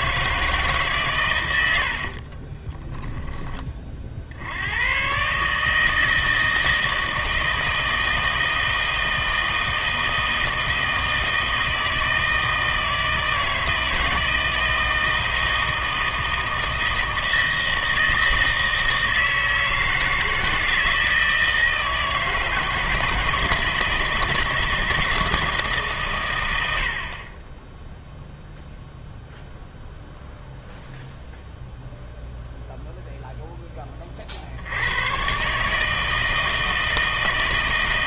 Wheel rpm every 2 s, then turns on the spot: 150, 20, 90, 160, 160, 160, 160, 160, 160, 160, 160, 160, 160, 90, 0, 0, 0, 100, 160.
2-4